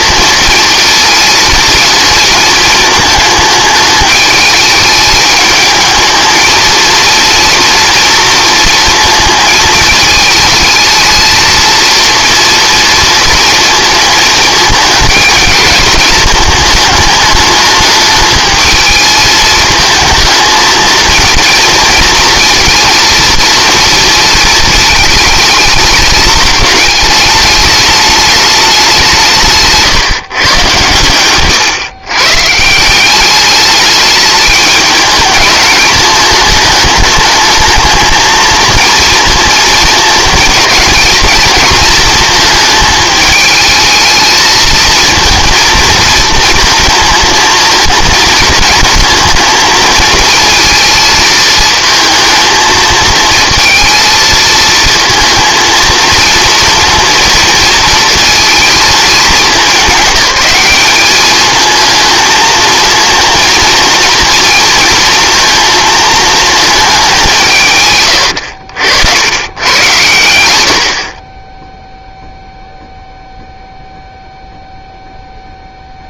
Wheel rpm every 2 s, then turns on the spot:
230, 220, 210, 230, 230, 220, 240, 210, 220, 220, 220, 230, 220, 210, 190, 120, 170, 210, 210, 230, 230, 220, 220, 230, 230, 230, 220, 230, 230, 220, 200, 230, 230, 220, 80, 70, 0, 0.
none